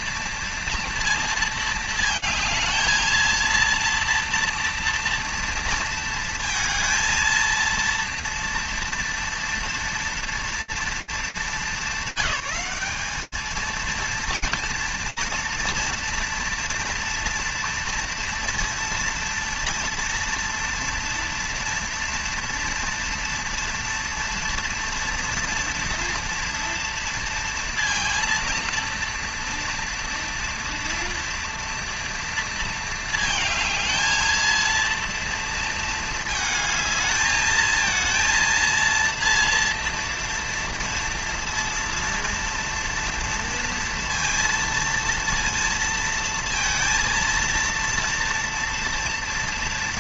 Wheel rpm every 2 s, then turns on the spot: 230, 220, 230, 230, 230, 230, 210, 230, 230, 230, 230, 230, 230, 230, 230, 230, 220, 230, 220, 230, 230, 230, 230, 230, 230.
none